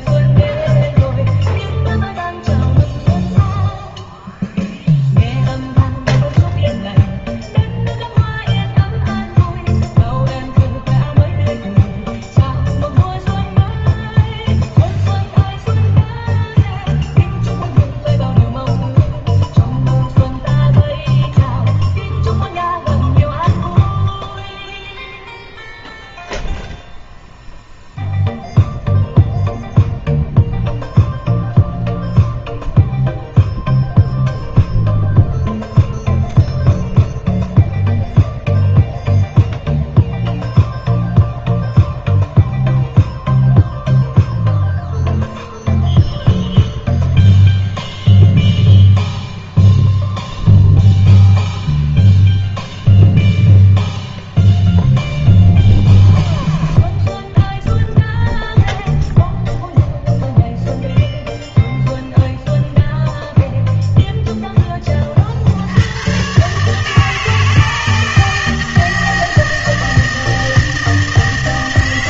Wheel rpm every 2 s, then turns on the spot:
0, 0, 0, 0, 0, 0, 0, 0, 0, 0, 0, 0, 0, 0, 0, 0, 0, 0, 0, 0, 0, 0, 0, 0, 0, 0, 0, 0, 0, 0, 0, 0, 20, 150, 160, 160.
none